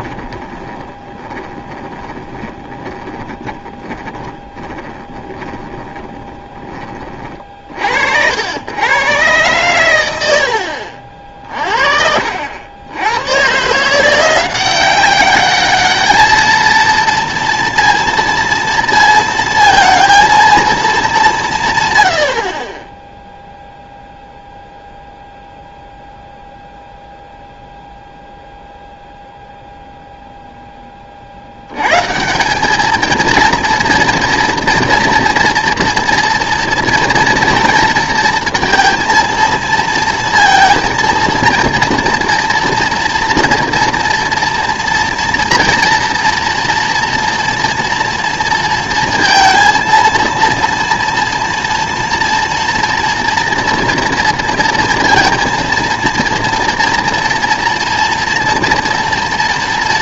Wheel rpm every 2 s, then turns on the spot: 10, 20, 20, 20, 90, 80, 70, 180, 220, 230, 220, 30, 0, 0, 0, 10, 200, 230, 230, 230, 230, 240, 240, 230, 230, 230, 230, 230, 230, 230.
0-6